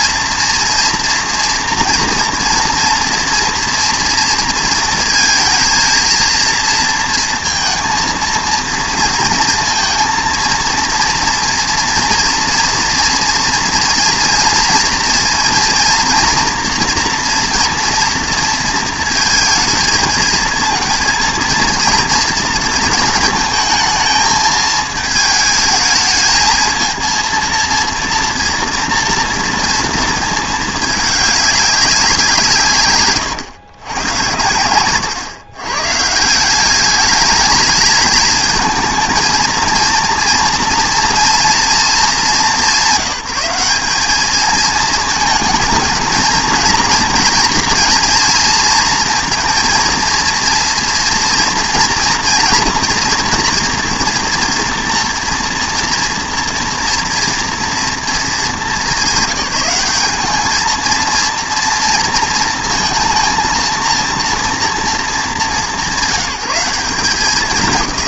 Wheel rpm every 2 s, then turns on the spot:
230, 230, 230, 230, 230, 230, 240, 230, 230, 230, 230, 220, 220, 220, 230, 220, 170, 100, 190, 220, 230, 190, 220, 230, 230, 230, 230, 230, 230, 190, 220, 230, 230, 190.
none